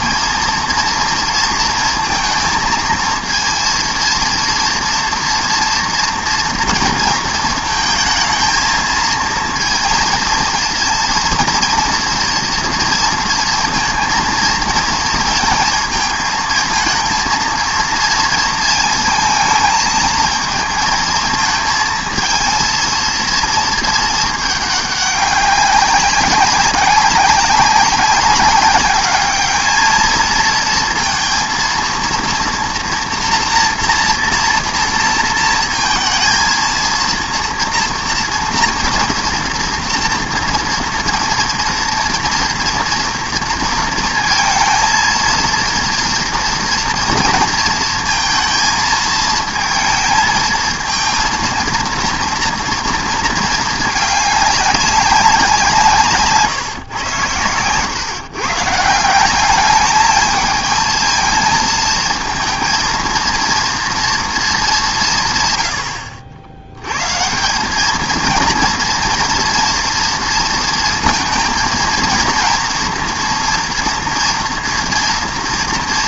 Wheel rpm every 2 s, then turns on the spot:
230, 230, 230, 230, 220, 230, 230, 230, 220, 230, 220, 220, 210, 190, 200, 220, 230, 230, 220, 240, 230, 230, 230, 230, 220, 220, 230, 200, 140, 140, 220, 230, 210, 90, 230, 230, 230, 230.
none